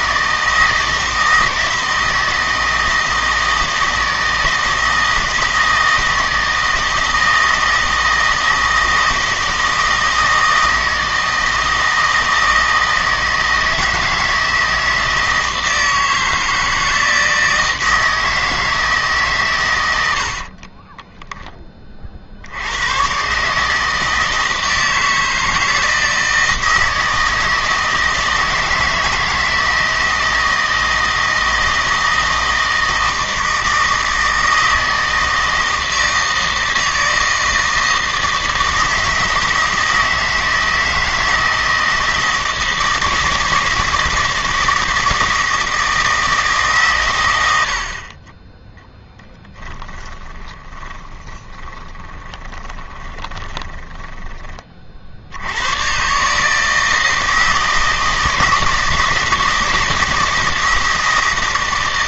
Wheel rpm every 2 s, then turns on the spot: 160, 160, 160, 160, 160, 160, 160, 160, 160, 160, 20, 90, 160, 160, 160, 160, 160, 160, 160, 160, 160, 160, 160, 140, 10, 10, 20, 40, 160, 160, 160.
20-22 50-54